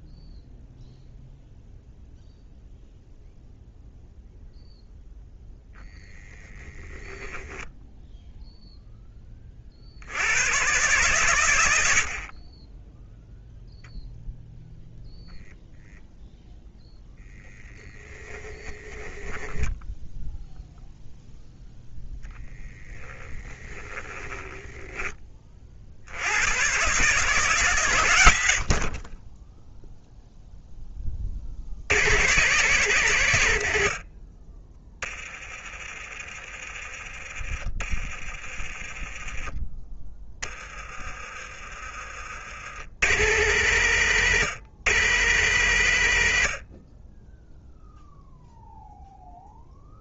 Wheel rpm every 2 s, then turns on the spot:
0, 0, 0, 10, 0, 120, 0, 0, 0, 10, 0, 10, 10, 130, 30, 20, 150, 20, 30, 20, 30, 110, 140, 20, 0.
6-8 40-42